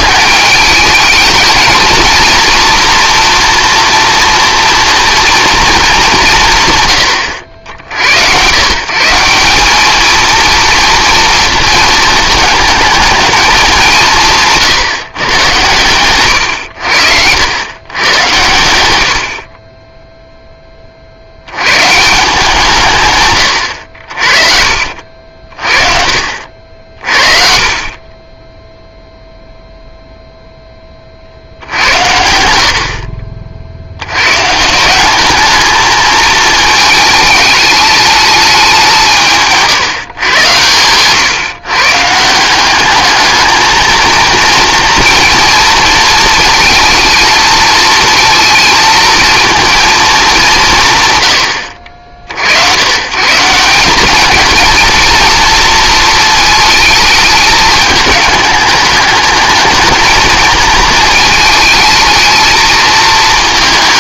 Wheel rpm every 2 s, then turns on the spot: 210, 240, 230, 140, 130, 230, 220, 160, 90, 100, 20, 150, 50, 50, 10, 10, 60, 160, 220, 190, 120, 190, 230, 230, 230, 170, 70, 230, 220, 210, 220, 220.
none